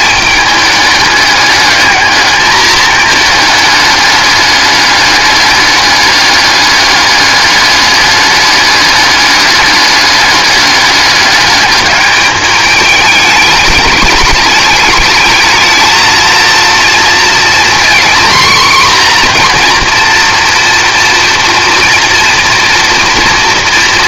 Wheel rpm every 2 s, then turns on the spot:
210, 210, 210, 200, 210, 210, 210, 210, 230, 240, 230, 230.
none